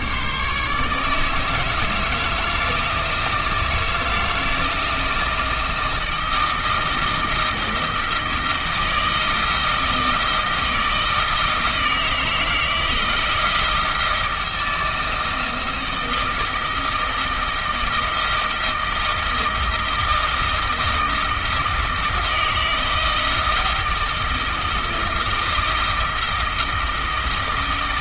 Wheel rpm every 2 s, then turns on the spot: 150, 160, 160, 160, 160, 160, 160, 160, 160, 160, 160, 160, 160, 160.
none